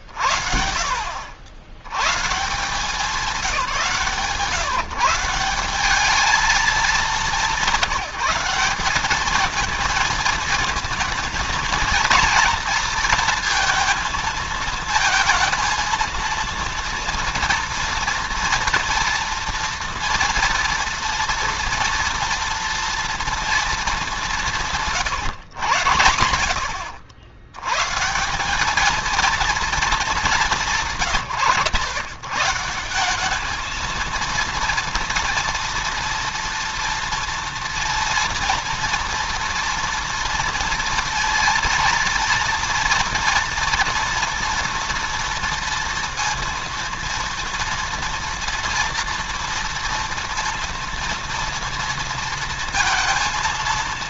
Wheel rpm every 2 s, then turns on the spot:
70, 170, 150, 210, 190, 230, 230, 220, 230, 230, 240, 230, 160, 70, 210, 170, 180, 230, 230, 230, 230, 230, 240, 230, 230, 230, 230.
none